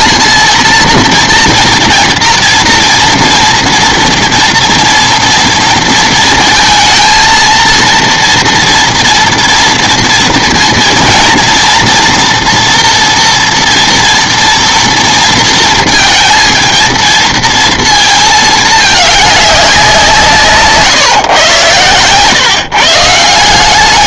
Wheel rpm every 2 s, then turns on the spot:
230, 230, 230, 230, 230, 230, 230, 230, 230, 210, 150, 150.
none